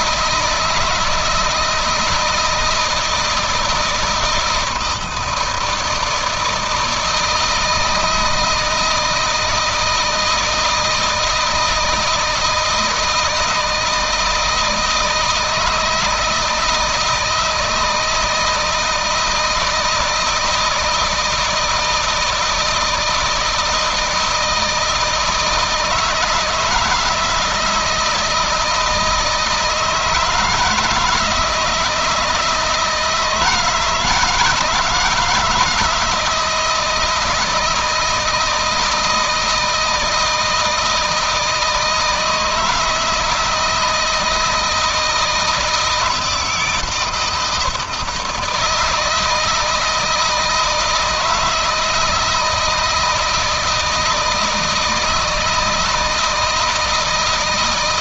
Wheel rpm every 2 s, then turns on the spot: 160, 160, 160, 160, 160, 160, 160, 160, 160, 170, 160, 160, 160, 160, 160, 160, 160, 160, 160, 160, 160, 160, 160, 160, 170, 160, 160, 160, 160.
none